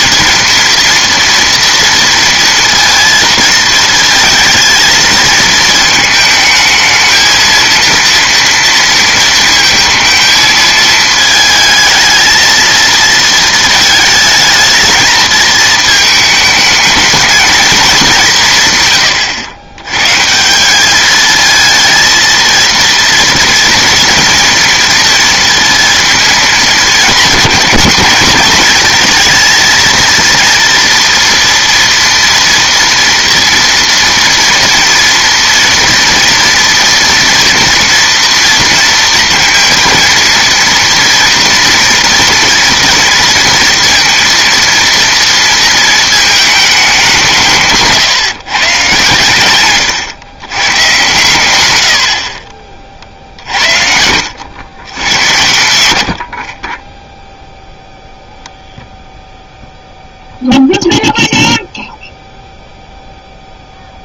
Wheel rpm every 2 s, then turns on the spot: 230, 230, 220, 220, 230, 220, 230, 220, 210, 140, 180, 230, 230, 210, 210, 230, 230, 230, 230, 230, 240, 230, 230, 210, 140, 120, 40, 100, 30, 0, 0, 0.
none